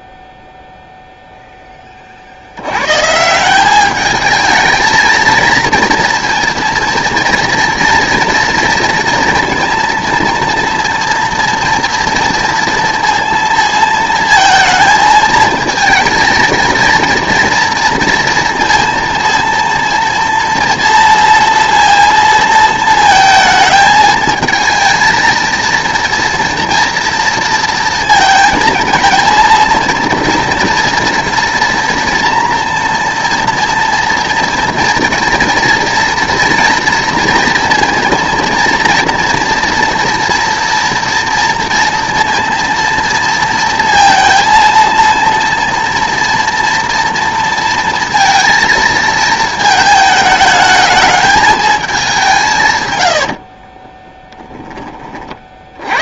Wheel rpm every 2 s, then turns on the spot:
0, 90, 220, 230, 230, 230, 230, 230, 230, 230, 230, 230, 220, 230, 220, 240, 230, 230, 230, 230, 230, 230, 230, 230, 230, 220, 130, 20.
none